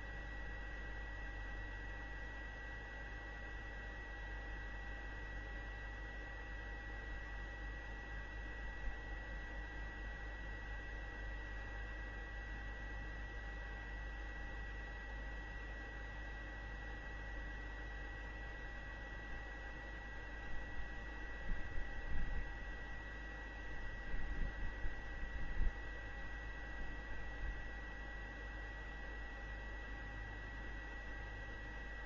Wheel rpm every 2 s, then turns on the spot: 0, 0, 0, 0, 0, 0, 0, 0, 0, 0, 0, 0, 0, 0, 0, 0.
none